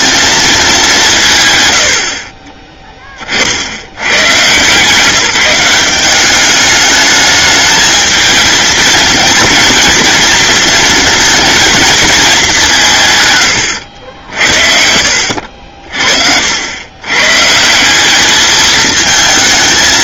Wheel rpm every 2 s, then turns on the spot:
160, 30, 180, 210, 230, 230, 150, 60, 110, 220.
none